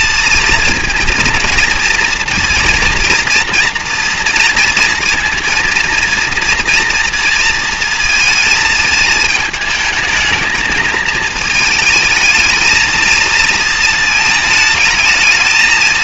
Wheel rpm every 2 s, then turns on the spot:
230, 240, 230, 230, 220, 220, 220, 220.
none